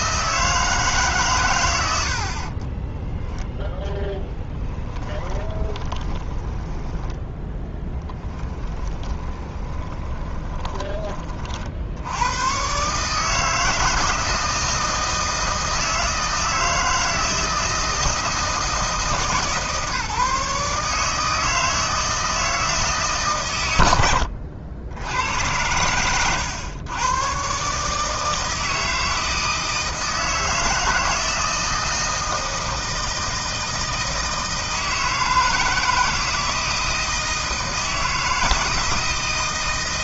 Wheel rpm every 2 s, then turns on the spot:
160, 20, 10, 10, 10, 20, 130, 160, 160, 160, 150, 160, 70, 100, 160, 160, 160, 160, 160, 160.
2-12